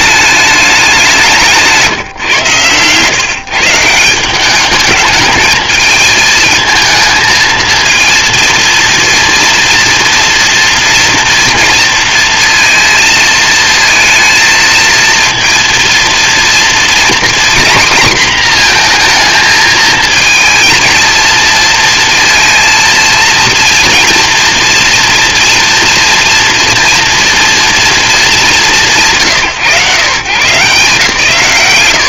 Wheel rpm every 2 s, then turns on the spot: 200, 120, 200, 220, 230, 230, 230, 230, 240, 230, 230, 230, 230, 240, 140, 140.
none